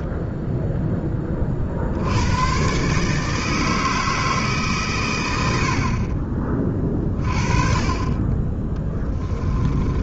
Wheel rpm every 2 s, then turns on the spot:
0, 140, 140, 30, 20.
8-10